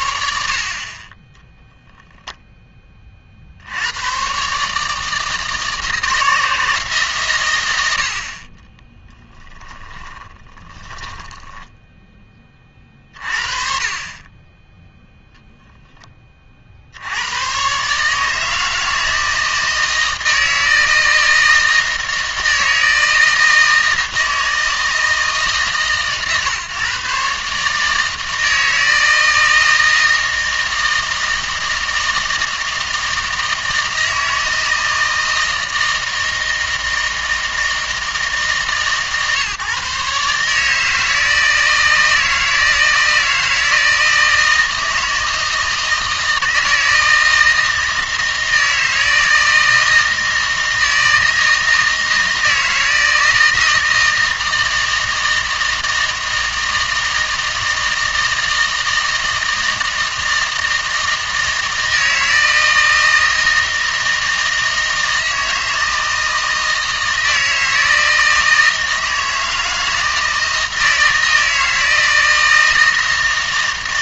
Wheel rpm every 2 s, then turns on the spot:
40, 10, 150, 150, 20, 20, 30, 10, 60, 160, 160, 160, 160, 140, 160, 160, 160, 160, 160, 140, 150, 160, 160, 160, 160, 160, 160, 160, 160, 160, 160, 160, 160, 160, 160, 160, 160.
8-12